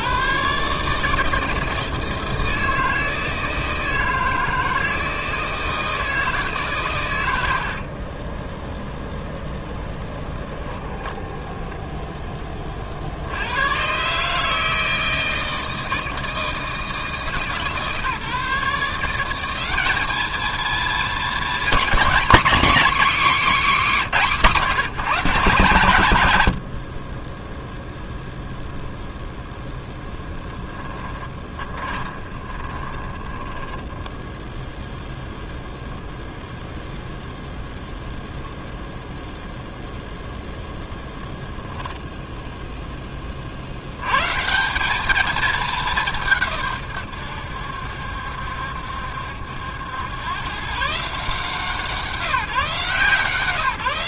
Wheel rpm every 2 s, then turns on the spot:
150, 160, 160, 120, 10, 10, 50, 160, 160, 170, 230, 270, 160, 50, 0, 20, 30, 0, 0, 0, 0, 10, 180, 120, 70, 130, 150.
10-12 30-34